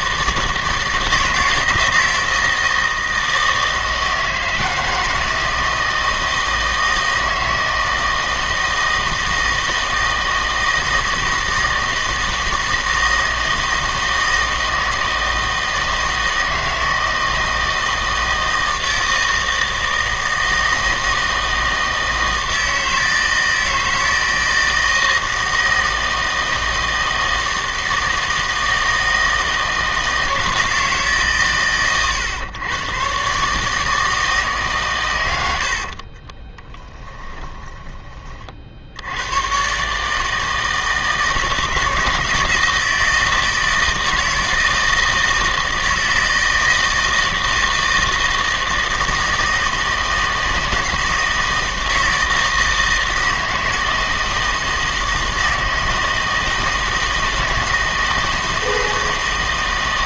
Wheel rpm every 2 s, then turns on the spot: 160, 160, 160, 160, 160, 160, 160, 160, 160, 160, 160, 160, 160, 160, 160, 160, 120, 140, 10, 50, 160, 160, 160, 160, 160, 160, 160, 160, 160, 160.
36-38